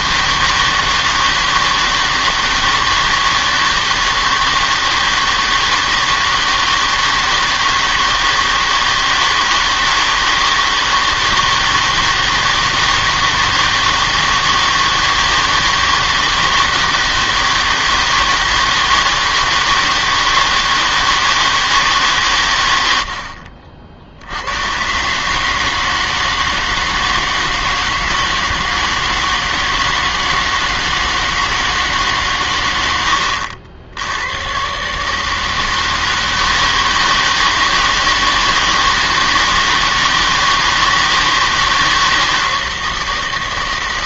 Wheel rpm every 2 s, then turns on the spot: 160, 160, 160, 160, 160, 160, 160, 160, 160, 160, 160, 110, 100, 160, 160, 160, 110, 120, 160, 160, 160, 160.
none